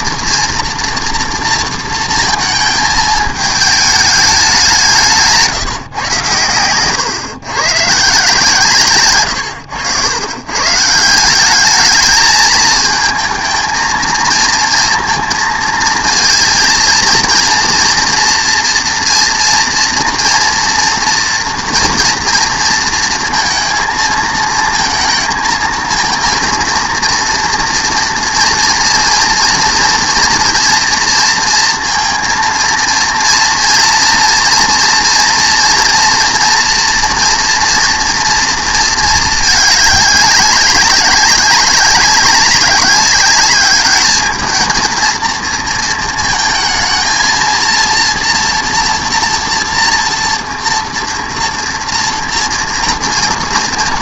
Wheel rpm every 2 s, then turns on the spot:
230, 220, 190, 120, 150, 140, 220, 230, 230, 230, 230, 230, 220, 230, 240, 230, 230, 240, 230, 230, 190, 200, 220, 220, 230, 230, 230.
none